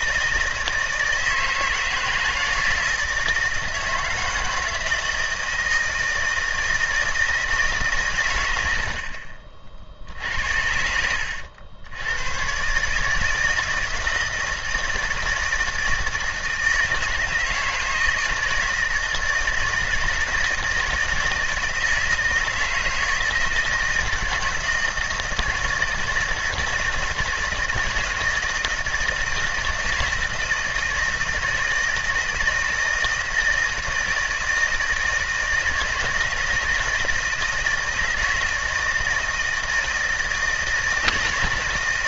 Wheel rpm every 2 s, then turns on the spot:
160, 160, 160, 160, 70, 80, 140, 160, 160, 160, 160, 160, 160, 160, 160, 160, 160, 160, 160, 160, 160.
none